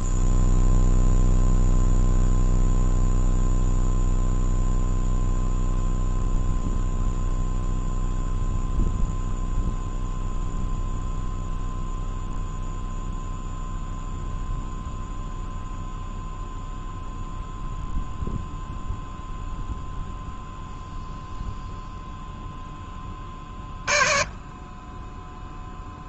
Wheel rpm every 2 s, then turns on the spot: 0, 0, 0, 0, 0, 0, 0, 0, 0, 0, 0, 10, 20.
none